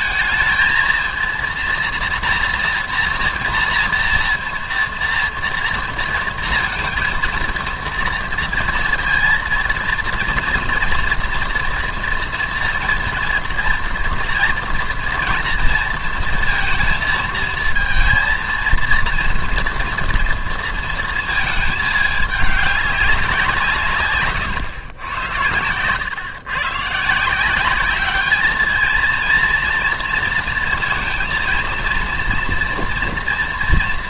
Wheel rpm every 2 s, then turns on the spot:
220, 240, 230, 230, 230, 230, 230, 230, 230, 230, 230, 200, 120, 130, 210, 230, 230.
none